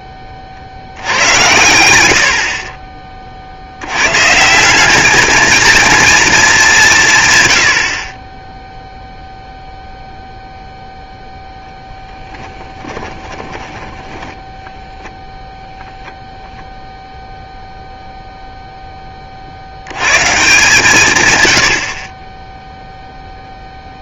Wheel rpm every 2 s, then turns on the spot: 40, 40, 180, 230, 10, 0, 10, 10, 0, 0, 140, 10.
14-16